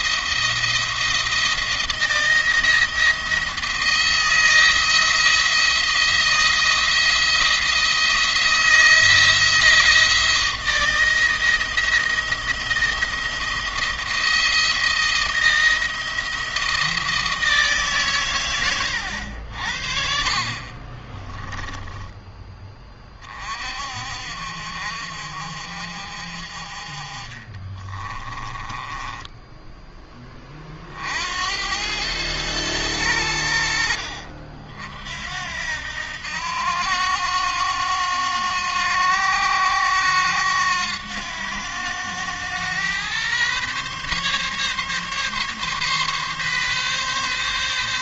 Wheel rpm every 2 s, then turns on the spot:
170, 170, 170, 170, 160, 160, 170, 170, 170, 100, 40, 20, 60, 40, 20, 50, 100, 60, 90, 90, 90, 110, 140, 140.
20-22 28-30